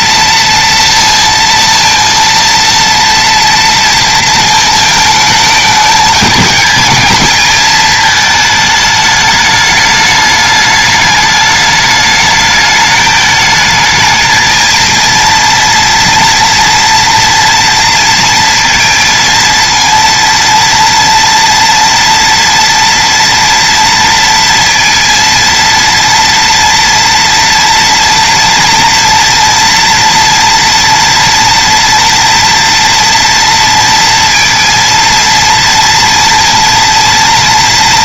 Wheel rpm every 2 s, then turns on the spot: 230, 230, 230, 220, 220, 210, 210, 220, 230, 230, 230, 230, 230, 230, 230, 230, 230, 230, 230.
none